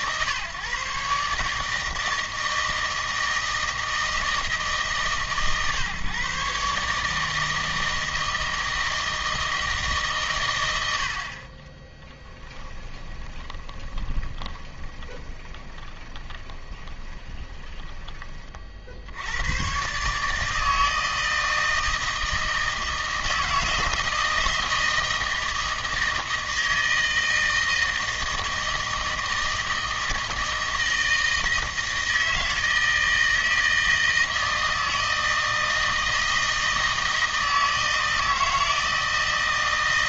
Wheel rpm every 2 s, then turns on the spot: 140, 160, 150, 140, 160, 110, 10, 20, 20, 40, 160, 160, 160, 160, 160, 160, 160, 160, 160, 160.
12-18